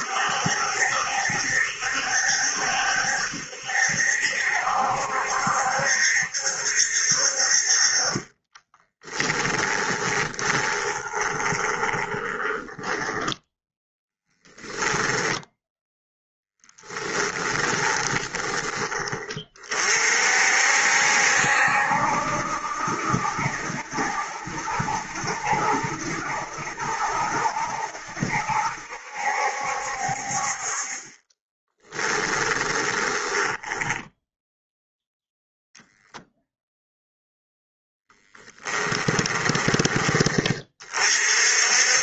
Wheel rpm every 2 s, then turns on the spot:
70, 70, 70, 70, 20, 20, 10, 10, 20, 20, 60, 70, 70, 70, 70, 40, 10, 0, 0, 10, 40.
8-14 16-18 32-34 38-40